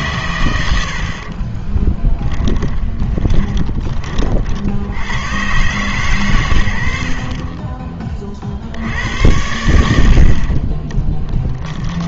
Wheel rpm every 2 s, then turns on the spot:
100, 20, 60, 110, 60, 40.
2-4